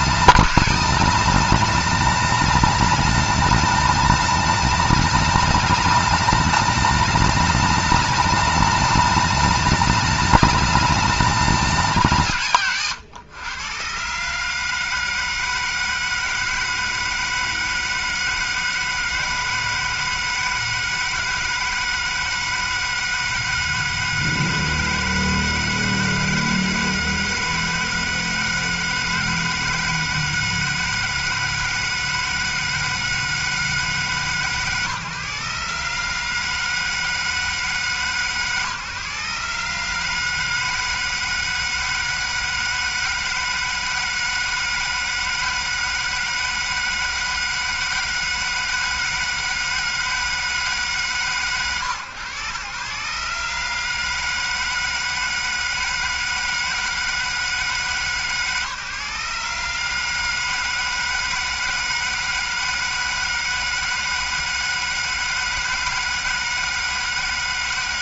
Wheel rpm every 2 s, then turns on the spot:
200, 210, 210, 210, 210, 210, 140, 160, 160, 160, 160, 160, 160, 160, 160, 160, 160, 140, 160, 150, 160, 160, 160, 160, 160, 160, 120, 160, 160, 150, 160, 160, 160, 160.
none